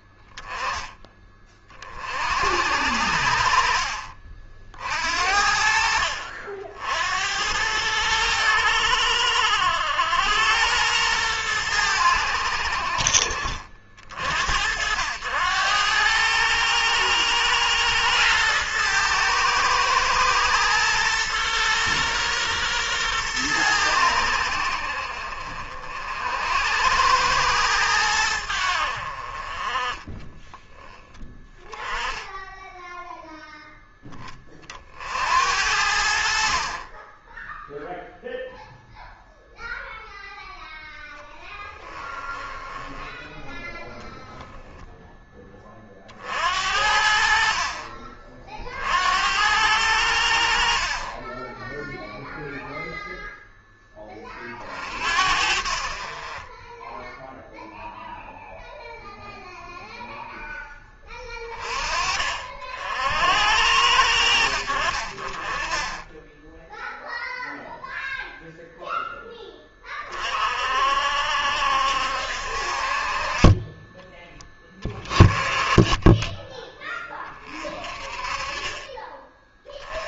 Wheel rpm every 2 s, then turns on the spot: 10, 70, 50, 60, 90, 100, 70, 80, 110, 110, 110, 120, 70, 80, 80, 10, 10, 50, 30, 0, 0, 10, 0, 60, 60, 50, 0, 40, 20, 0, 10, 50, 60, 10, 0, 50, 50, 10, 20, 30.
42-44